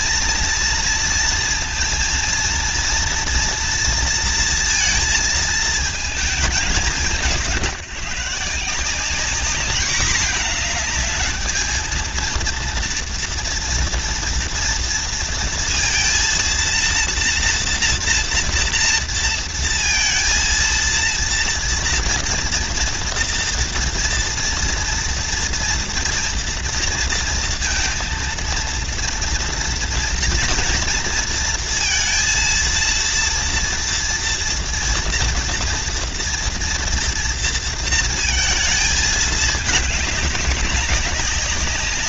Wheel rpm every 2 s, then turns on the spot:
230, 230, 230, 200, 180, 220, 230, 230, 230, 230, 230, 240, 230, 230, 230, 240, 230, 240, 240, 230, 190.
none